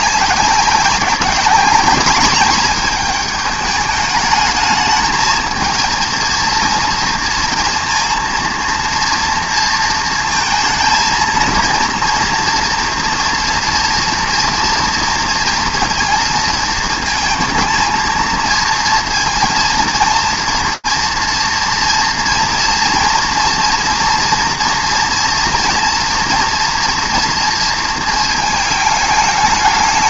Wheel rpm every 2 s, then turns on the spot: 190, 210, 210, 230, 230, 220, 240, 230, 220, 230, 230, 230, 230, 240, 220.
none